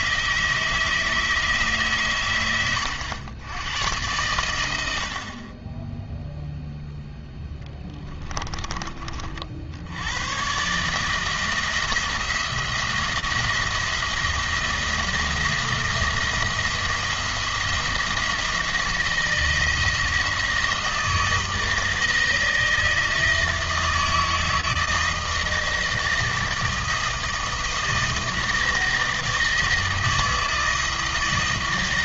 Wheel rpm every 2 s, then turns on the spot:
160, 100, 80, 0, 30, 140, 170, 170, 170, 160, 160, 160, 160, 160, 160, 160.
none